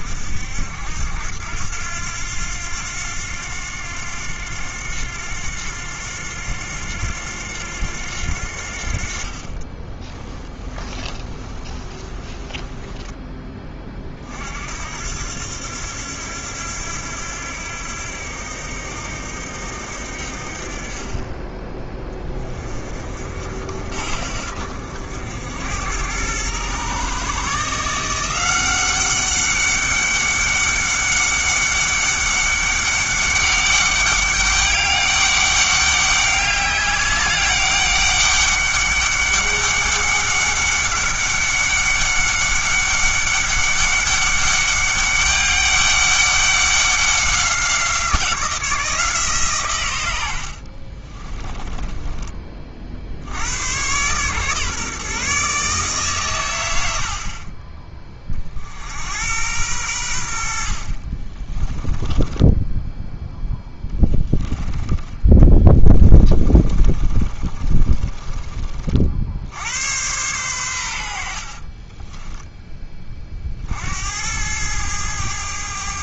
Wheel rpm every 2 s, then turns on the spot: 80, 90, 90, 90, 60, 20, 10, 70, 90, 80, 40, 40, 70, 120, 190, 200, 200, 200, 200, 200, 200, 200, 200, 190, 170, 40, 40, 140, 90, 60, 60, 0, 10, 30, 40, 90, 20, 100.
10-14 50-52 66-68